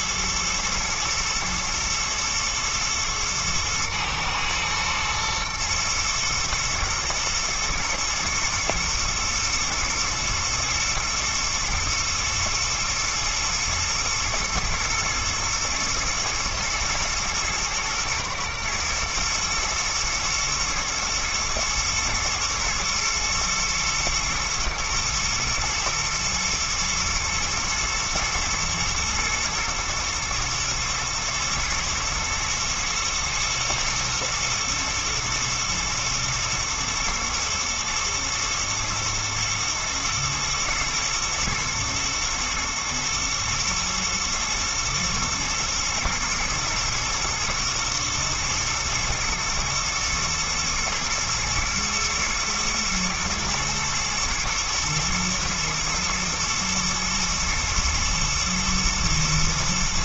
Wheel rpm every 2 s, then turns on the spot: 120, 110, 120, 120, 120, 120, 110, 120, 120, 110, 120, 120, 120, 110, 110, 110, 110, 110, 120, 120, 110, 110, 110, 120, 120, 120, 120, 110, 120, 120.
none